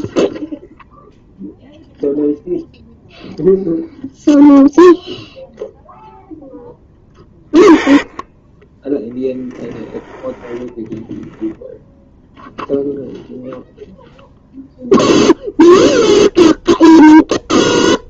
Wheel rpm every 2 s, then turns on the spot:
0, 0, 0, 10, 10, 10, 0, 0, 0.
none